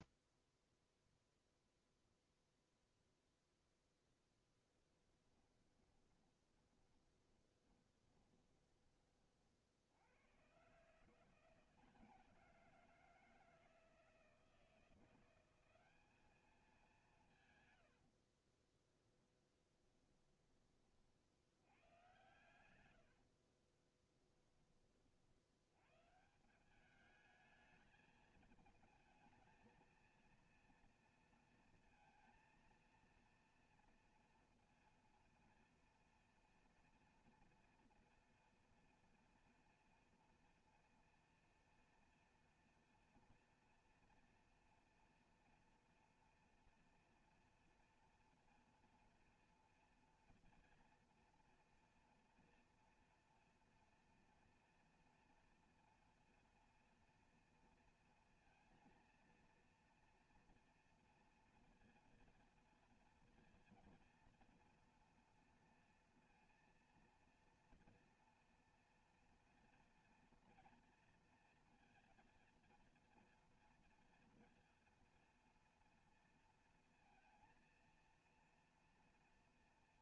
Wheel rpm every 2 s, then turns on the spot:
0, 0, 10, 30, 20, 140, 170, 170, 200, 30, 40, 90, 30, 200, 220, 230, 230, 230, 230, 230, 230, 240, 230, 230, 230, 240, 240, 230, 230, 230, 230, 230, 230, 230, 230, 230, 230, 230, 230, 230.
4-8 18-20